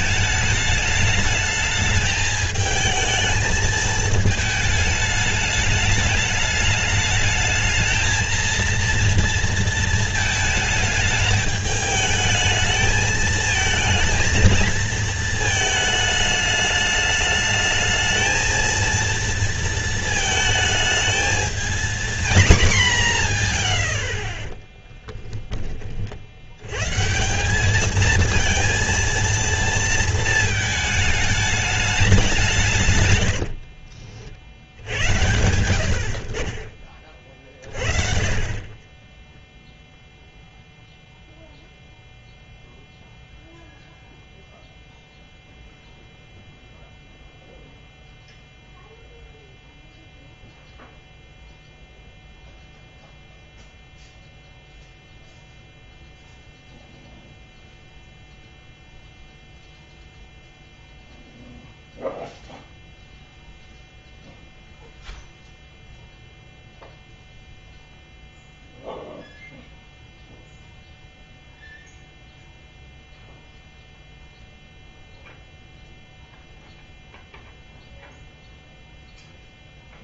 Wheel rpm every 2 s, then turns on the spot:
210, 220, 210, 210, 230, 220, 220, 230, 210, 220, 220, 220, 20, 110, 230, 220, 140, 70, 30, 30, 0, 0, 0, 0, 0, 0, 0, 0, 0, 0, 0, 0, 0, 0, 0, 0, 0, 0, 0, 0.
24-26